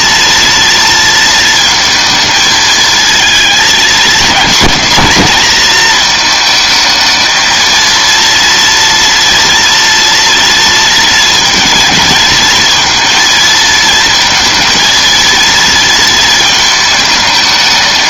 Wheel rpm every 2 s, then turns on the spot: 230, 220, 230, 220, 230, 230, 230, 230, 220.
none